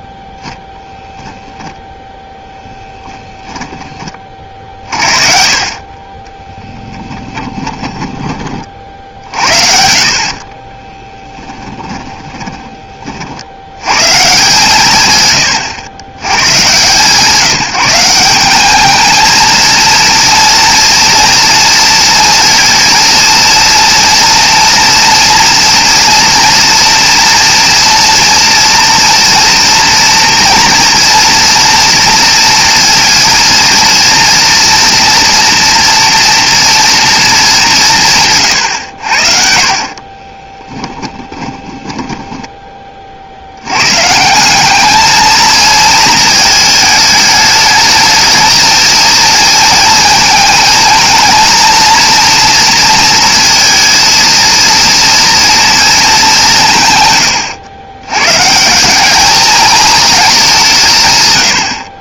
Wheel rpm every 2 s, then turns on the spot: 10, 10, 40, 10, 40, 30, 40, 130, 150, 220, 230, 230, 230, 230, 230, 240, 230, 230, 230, 80, 10, 20, 200, 220, 220, 230, 230, 230, 170, 150, 170.
2-4 6-8 10-12 40-42